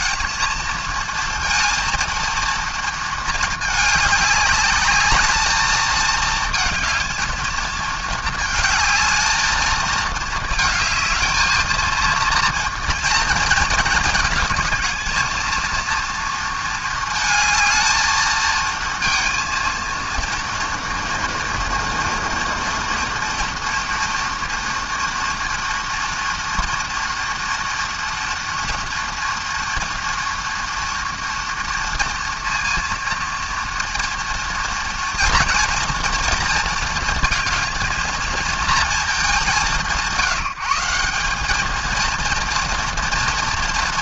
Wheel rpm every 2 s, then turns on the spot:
220, 230, 210, 230, 220, 220, 230, 220, 230, 220, 230, 230, 240, 230, 230, 230, 230, 230, 230, 230, 180, 230.
none